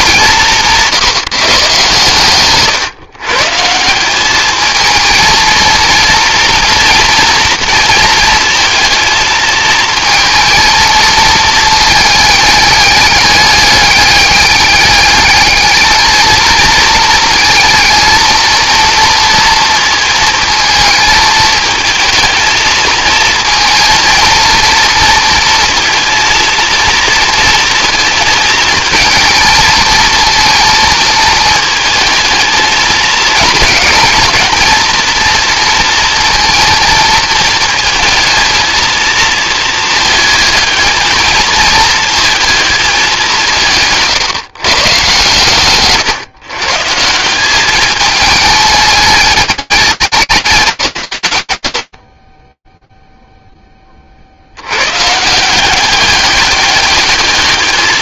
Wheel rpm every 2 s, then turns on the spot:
180, 130, 210, 230, 230, 230, 210, 200, 220, 230, 230, 220, 220, 230, 230, 230, 220, 220, 230, 230, 220, 220, 150, 150, 210, 150, 20, 60, 200.
none